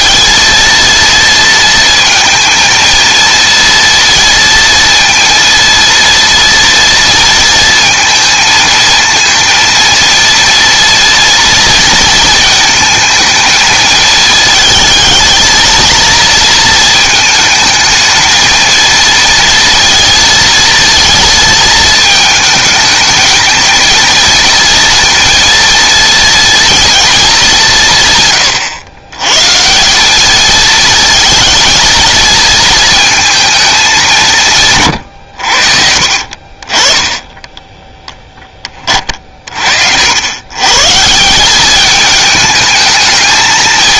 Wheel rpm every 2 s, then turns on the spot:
230, 230, 230, 230, 230, 230, 220, 220, 220, 230, 230, 220, 230, 230, 110, 220, 220, 120, 20, 30, 140, 220.
none